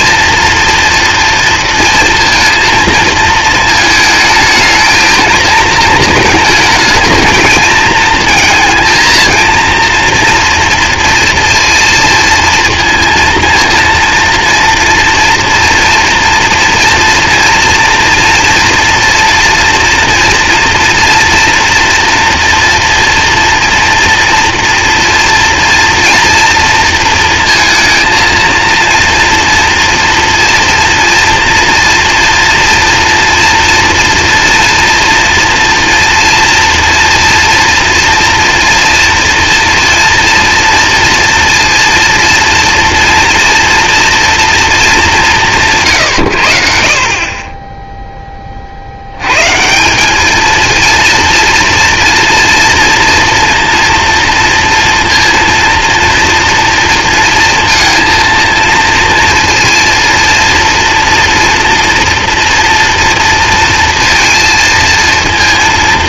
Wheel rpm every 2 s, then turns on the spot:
230, 230, 220, 220, 230, 230, 230, 230, 230, 230, 230, 230, 230, 230, 230, 230, 240, 230, 230, 230, 230, 230, 230, 70, 40, 220, 230, 230, 240, 230, 240, 230, 230.
none